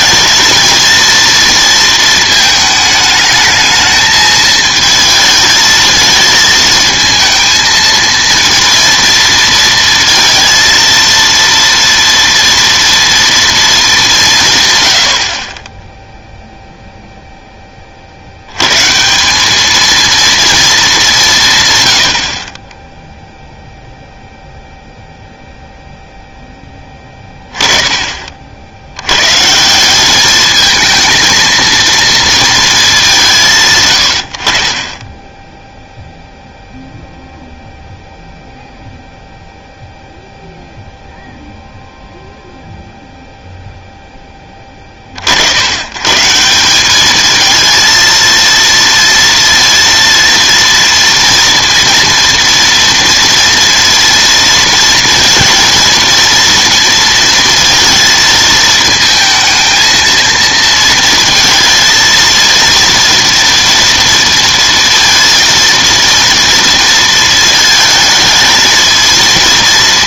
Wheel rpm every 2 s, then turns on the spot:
230, 220, 220, 220, 230, 230, 230, 130, 0, 110, 220, 20, 0, 10, 70, 220, 220, 50, 0, 0, 0, 0, 20, 190, 230, 230, 230, 230, 230, 230, 230, 230, 230, 230, 220.
none